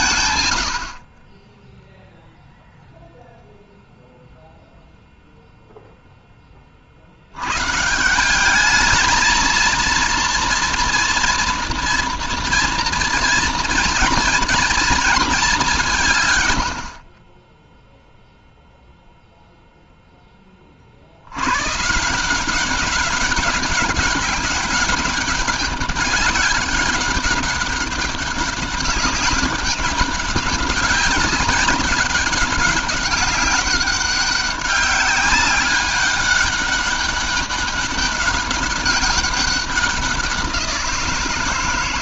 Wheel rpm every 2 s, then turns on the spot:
120, 0, 0, 30, 190, 230, 230, 220, 100, 0, 20, 180, 200, 200, 200, 190, 190, 200, 200, 200, 180.
none